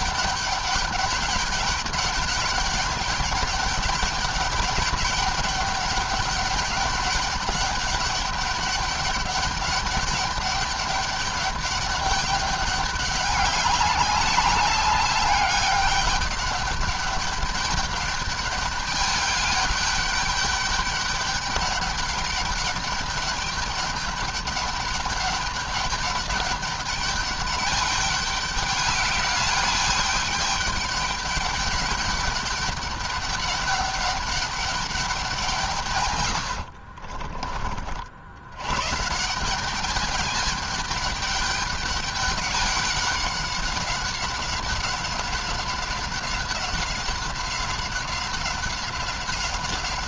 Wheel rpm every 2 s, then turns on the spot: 200, 200, 200, 200, 200, 200, 200, 200, 200, 210, 200, 200, 200, 200, 200, 200, 200, 200, 80, 120, 210, 190, 190, 190, 190.
36-38